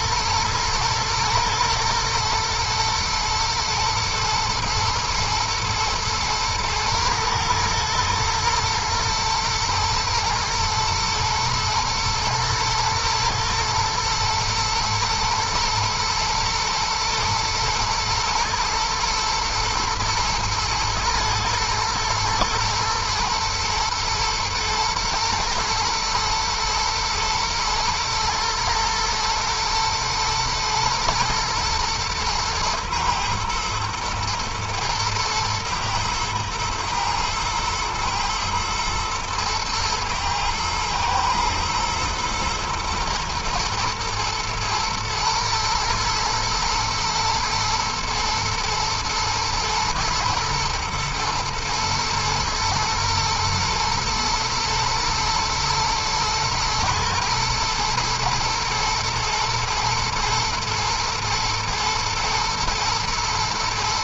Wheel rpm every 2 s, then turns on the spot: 120, 120, 120, 110, 110, 120, 120, 110, 110, 110, 110, 120, 110, 120, 120, 110, 110, 120, 120, 120, 120, 110, 110, 110, 110, 110, 110, 110, 110, 120, 110, 120.
none